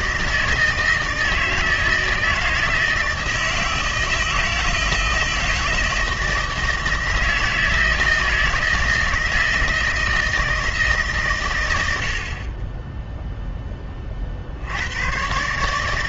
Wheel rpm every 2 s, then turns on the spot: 160, 160, 160, 160, 160, 160, 30, 70.
none